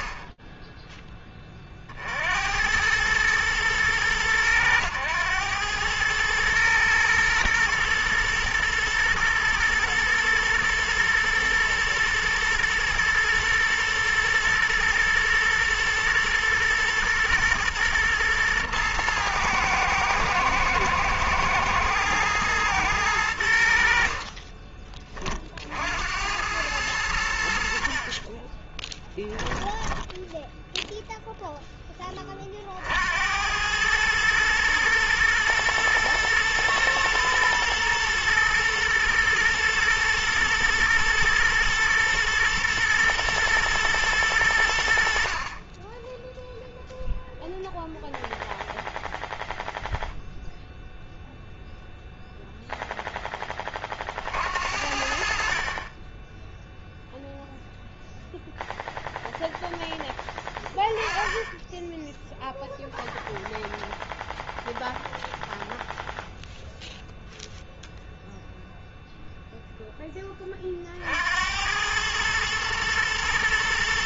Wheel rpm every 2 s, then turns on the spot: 80, 100, 110, 110, 110, 110, 110, 120, 120, 110, 110, 30, 90, 30, 0, 20, 110, 120, 120, 120, 120, 110, 10, 0, 0, 0, 30, 40, 0, 0, 10, 0, 0, 0, 0, 80, 120.
22-24